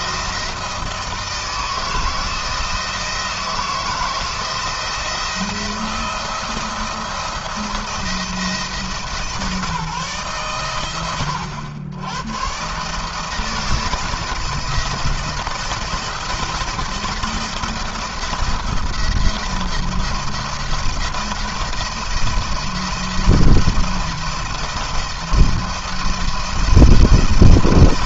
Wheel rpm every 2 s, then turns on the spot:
170, 160, 170, 170, 160, 130, 130, 170, 170, 170, 170, 170, 170, 170.
none